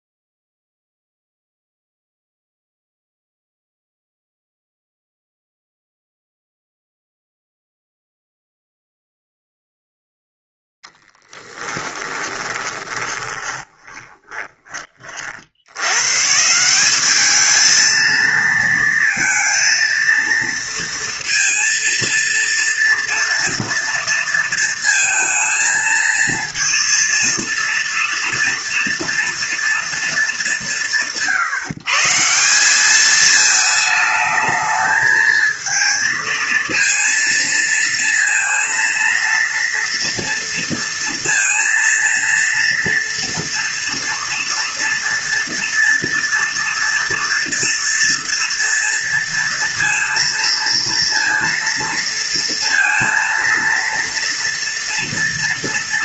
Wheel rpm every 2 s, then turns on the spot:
0, 0, 0, 0, 0, 0, 20, 20, 180, 230, 230, 230, 230, 230, 230, 170, 180, 220, 230, 230, 230, 230, 230, 230, 230, 230, 230, 230.
12-14